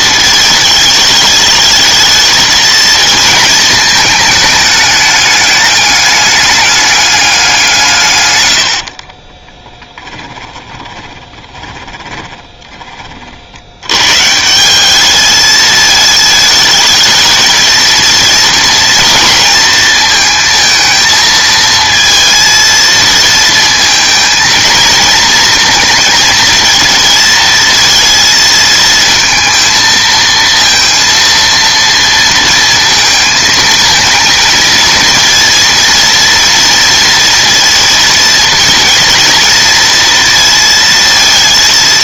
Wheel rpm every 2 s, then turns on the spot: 220, 220, 210, 210, 90, 20, 40, 180, 220, 230, 220, 230, 230, 230, 220, 230, 230, 220, 230, 230, 230.
10-12